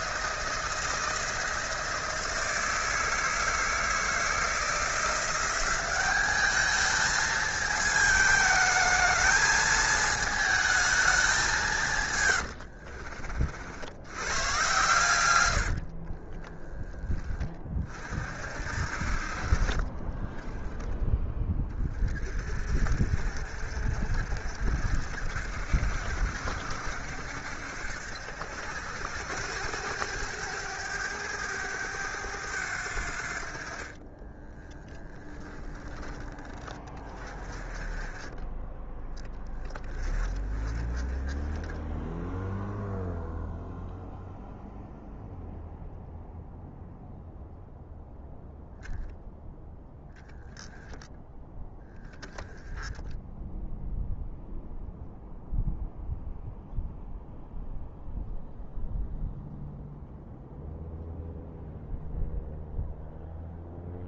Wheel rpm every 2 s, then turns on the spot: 160, 160, 170, 210, 220, 220, 70, 110, 20, 60, 10, 40, 60, 70, 80, 100, 80, 10, 20, 10, 20, 0, 0, 0, 0, 0, 10, 0, 0, 0, 0, 0.
12-14 16-18 34-36